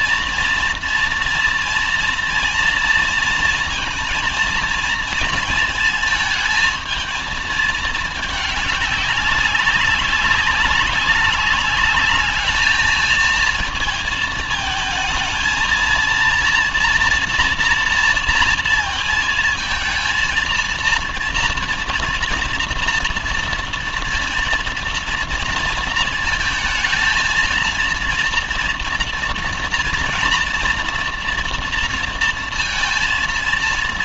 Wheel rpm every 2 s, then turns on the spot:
230, 230, 230, 220, 220, 200, 210, 220, 230, 230, 230, 230, 230, 220, 230, 230, 230.
none